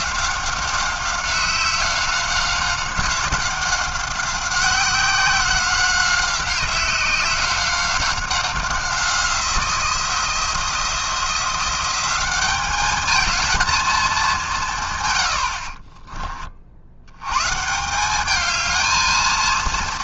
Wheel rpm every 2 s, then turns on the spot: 190, 190, 180, 190, 180, 170, 220, 100, 110, 230.
none